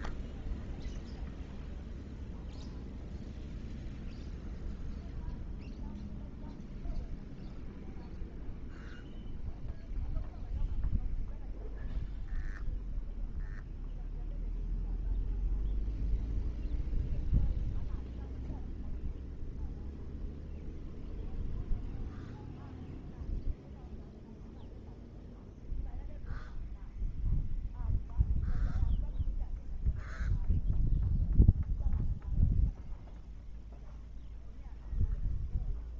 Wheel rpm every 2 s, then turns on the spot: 0, 0, 0, 0, 0, 0, 0, 0, 0, 0, 0, 0, 0, 0, 0, 0, 0, 0.
none